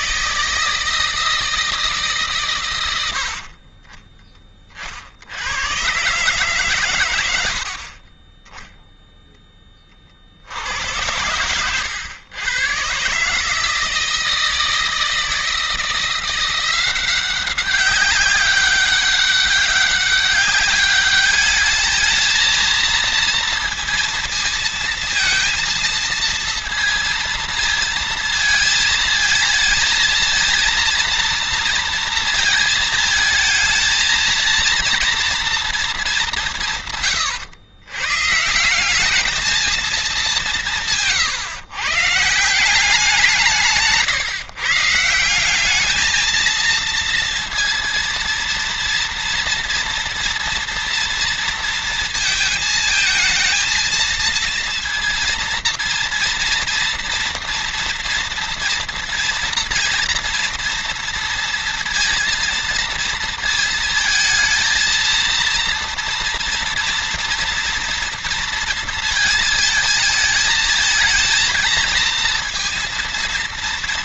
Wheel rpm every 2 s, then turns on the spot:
160, 80, 60, 100, 0, 90, 140, 160, 180, 190, 210, 230, 230, 230, 220, 230, 220, 230, 140, 200, 160, 170, 160, 230, 230, 230, 220, 230, 230, 230, 230, 230, 230, 230, 230, 220, 230.
none